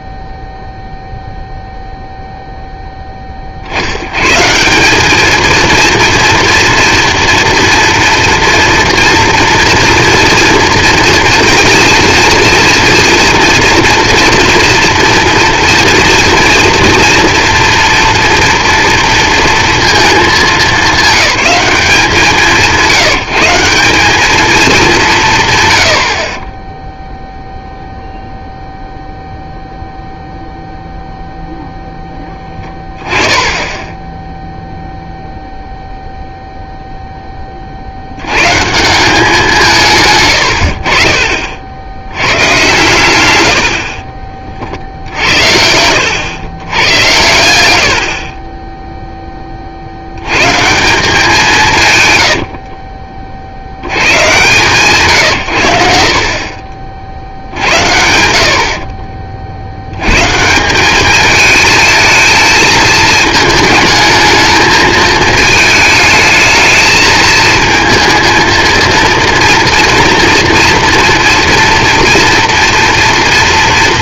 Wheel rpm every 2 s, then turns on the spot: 0, 0, 170, 230, 240, 230, 230, 230, 230, 230, 200, 180, 220, 20, 0, 0, 10, 0, 0, 150, 70, 120, 50, 90, 20, 150, 60, 140, 50, 60, 170, 220, 220, 220, 230, 240, 230.
26-28 52-54